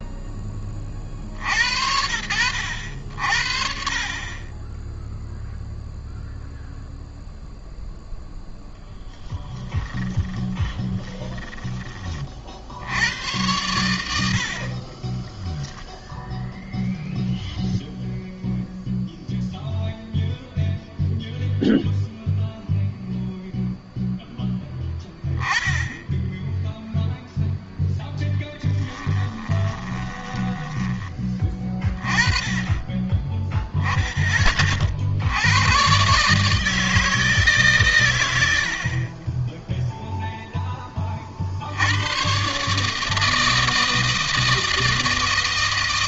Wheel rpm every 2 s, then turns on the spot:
30, 80, 10, 0, 10, 20, 70, 40, 0, 0, 0, 0, 10, 0, 10, 20, 20, 30, 150, 80, 10, 140, 160.
10-12 28-30